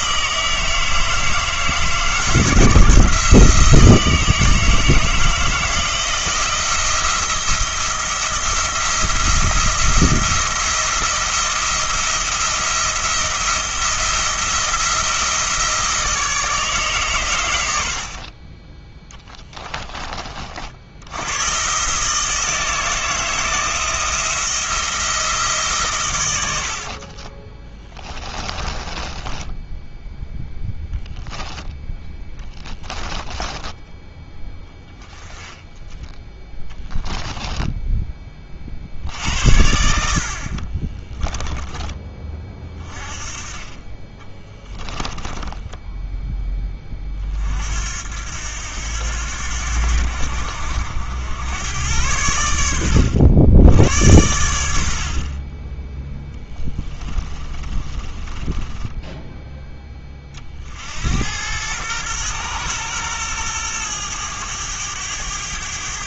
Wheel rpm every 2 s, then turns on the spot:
160, 160, 160, 170, 170, 170, 170, 170, 150, 20, 60, 160, 170, 70, 20, 10, 10, 10, 10, 50, 30, 30, 10, 20, 90, 80, 90, 80, 20, 20, 50, 120, 100.
28-30 32-34 36-38 40-42 44-46 56-60